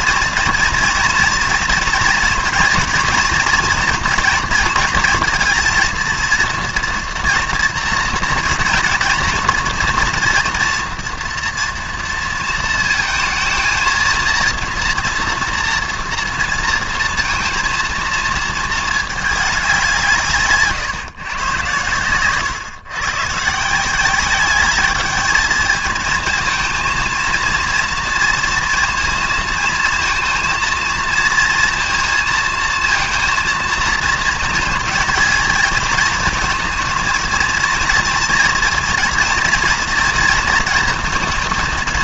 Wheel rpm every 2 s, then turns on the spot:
230, 230, 230, 230, 230, 240, 230, 230, 230, 220, 150, 120, 200, 220, 230, 230, 230, 230, 230, 240, 230.
none